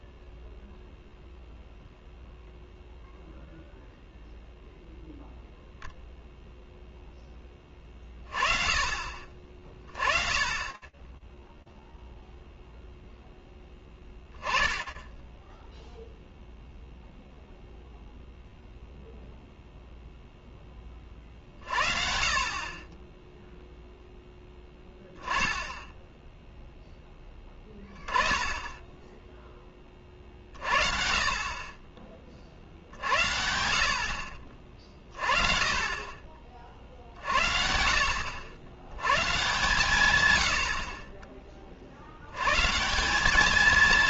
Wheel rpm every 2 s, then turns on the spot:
0, 0, 0, 0, 40, 10, 0, 0, 0, 0, 40, 10, 10, 10, 10, 50, 70, 30, 60, 130, 30, 200.
none